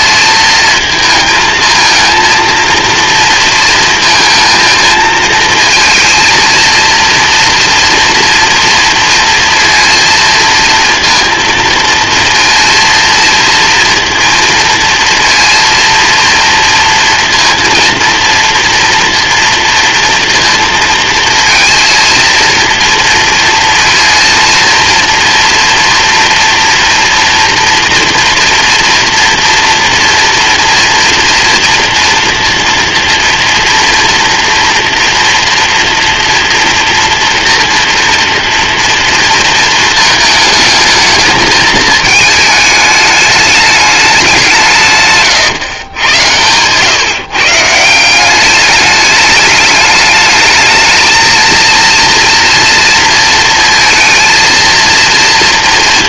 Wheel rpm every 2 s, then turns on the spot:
220, 230, 230, 220, 230, 230, 230, 230, 230, 230, 230, 230, 230, 230, 240, 230, 230, 230, 240, 230, 220, 220, 170, 110, 200, 220, 230, 230.
none